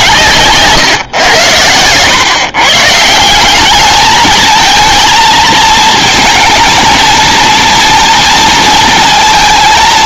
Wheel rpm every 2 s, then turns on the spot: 130, 150, 230, 230, 230.
none